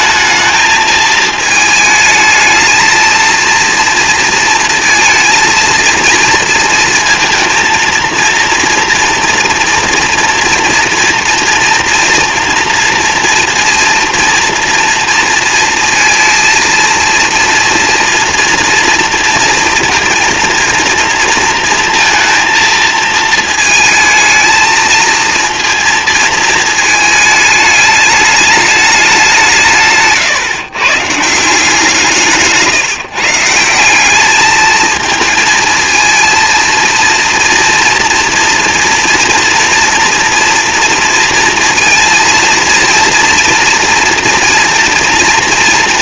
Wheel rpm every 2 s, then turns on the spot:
220, 220, 230, 230, 230, 240, 230, 230, 230, 230, 230, 220, 220, 220, 210, 140, 160, 220, 230, 230, 230, 230, 230.
none